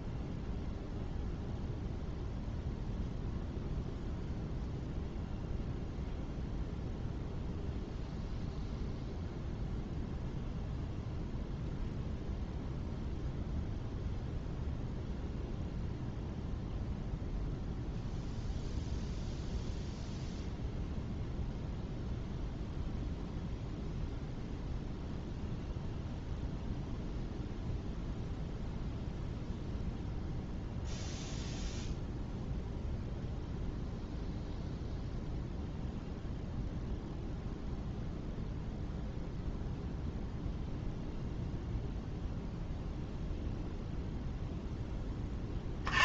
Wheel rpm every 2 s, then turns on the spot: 0, 0, 0, 0, 0, 0, 0, 0, 0, 0, 0, 0, 0, 0, 0, 0, 0, 0, 0, 0, 0, 0, 10.
none